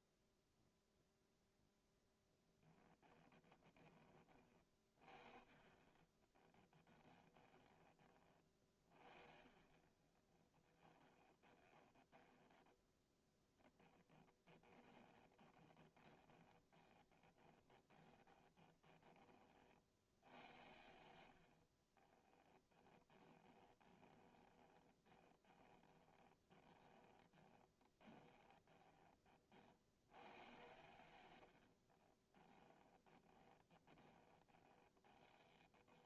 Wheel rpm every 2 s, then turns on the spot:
0, 10, 30, 10, 40, 10, 20, 20, 20, 20, 70, 10, 20, 30, 20, 90, 10, 20.
2-4 6-8 10-12 14-20 22-30 32-36